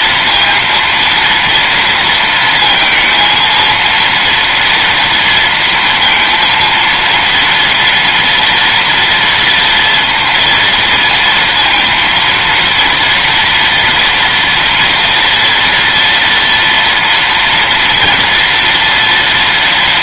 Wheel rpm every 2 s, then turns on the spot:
230, 230, 230, 230, 230, 230, 230, 230, 240, 230.
none